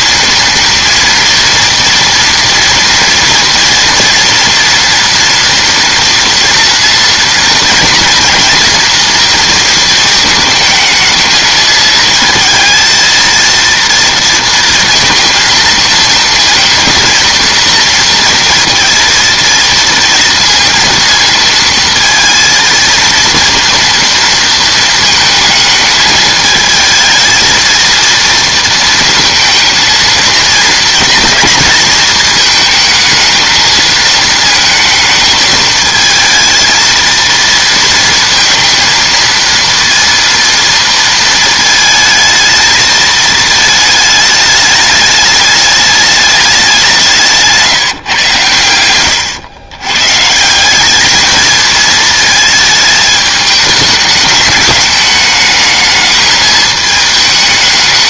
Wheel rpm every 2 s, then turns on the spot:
240, 230, 230, 230, 230, 220, 220, 230, 230, 230, 230, 230, 230, 220, 230, 220, 220, 220, 220, 230, 230, 220, 210, 200, 100, 190, 210, 200, 220.
none